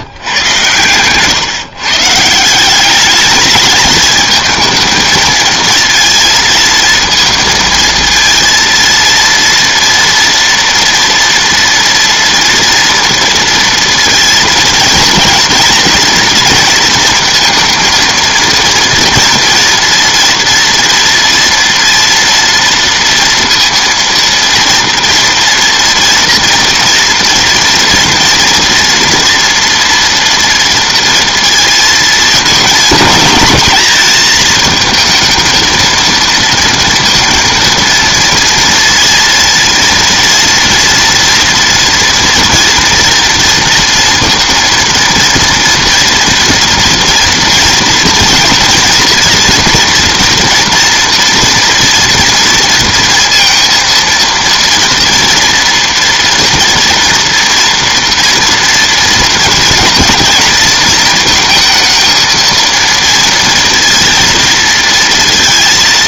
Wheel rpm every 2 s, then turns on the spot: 110, 190, 220, 220, 230, 230, 230, 230, 230, 230, 230, 230, 230, 230, 230, 230, 220, 220, 230, 230, 230, 230, 230, 240, 230, 230, 230, 230, 230, 230, 230, 230, 230.
none